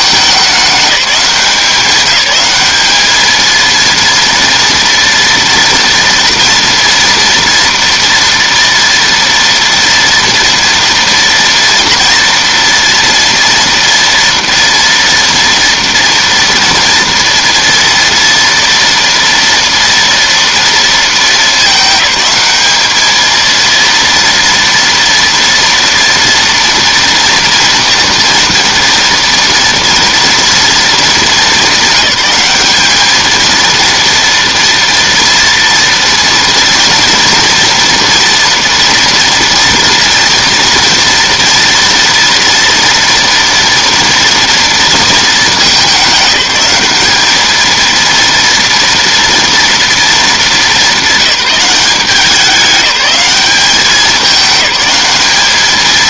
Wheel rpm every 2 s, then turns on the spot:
200, 210, 240, 230, 230, 230, 230, 230, 230, 230, 230, 210, 230, 240, 230, 230, 210, 230, 230, 240, 240, 230, 230, 210, 230, 210, 200, 200.
none